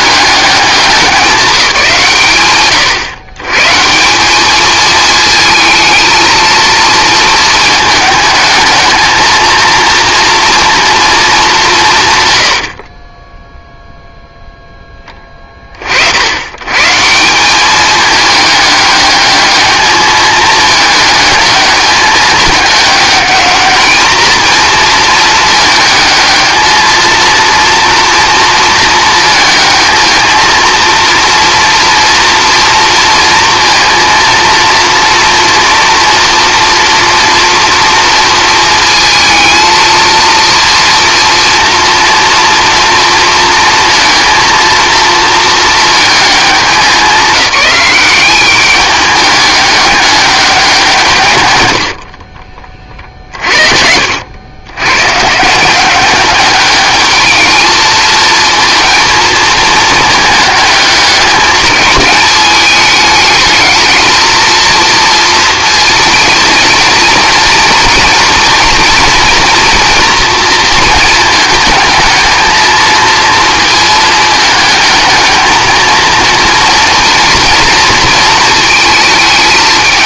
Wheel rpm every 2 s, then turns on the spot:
210, 130, 210, 220, 220, 230, 70, 10, 110, 210, 210, 210, 230, 220, 230, 230, 230, 230, 240, 230, 230, 230, 230, 200, 200, 190, 30, 100, 210, 230, 210, 210, 230, 220, 230, 230, 220, 220, 230, 230.
12-14 52-54